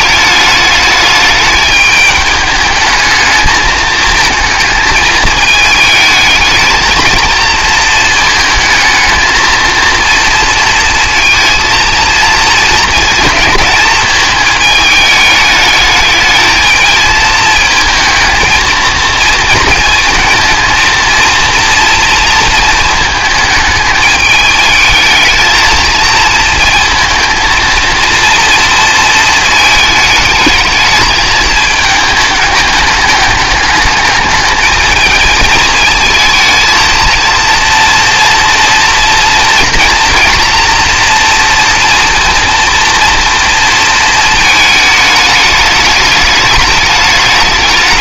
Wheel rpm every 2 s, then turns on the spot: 210, 210, 220, 220, 220, 230, 230, 210, 220, 220, 230, 220, 210, 220, 230, 220, 210, 210, 230, 240, 230, 230, 220, 210.
none